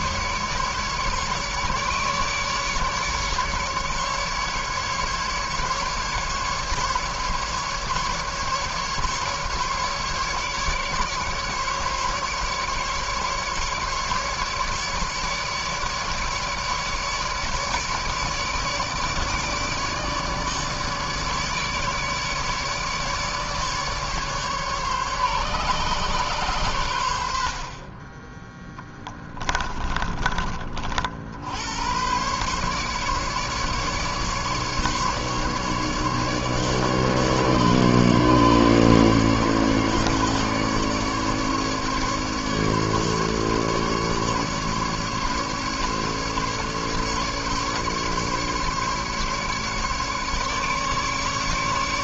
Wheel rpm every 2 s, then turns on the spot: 150, 150, 150, 150, 150, 150, 150, 150, 150, 150, 150, 150, 140, 130, 20, 30, 130, 150, 150, 150, 140, 150, 150, 150, 150, 150.
none